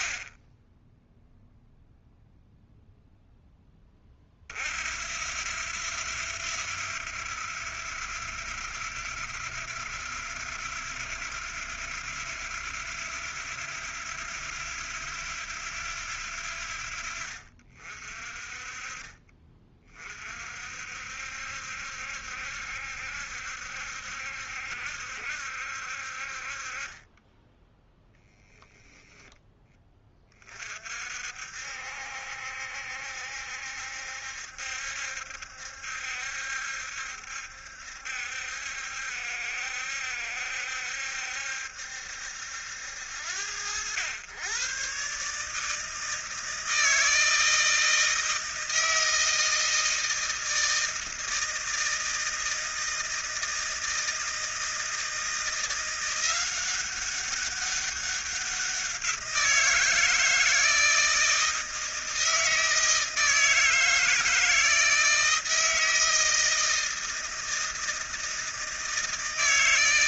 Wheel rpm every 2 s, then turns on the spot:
0, 0, 60, 90, 90, 90, 90, 90, 70, 40, 60, 70, 70, 30, 0, 50, 70, 70, 70, 70, 70, 70, 130, 160, 160, 160, 160, 160, 190, 180, 160, 160, 160, 160, 160.
none